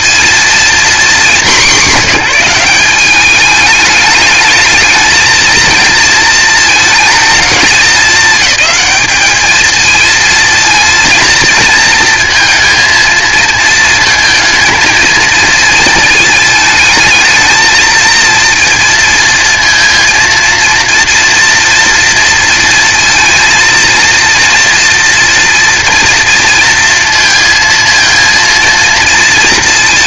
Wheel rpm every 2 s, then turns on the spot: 230, 200, 220, 220, 200, 230, 230, 230, 220, 230, 230, 230, 230, 230, 230.
none